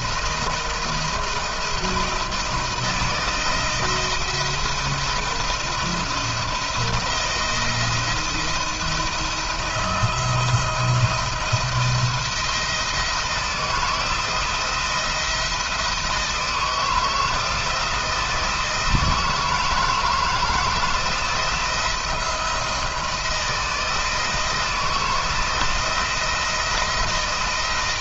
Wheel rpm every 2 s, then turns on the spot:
170, 170, 170, 170, 160, 170, 170, 170, 160, 160, 160, 160, 160, 170.
none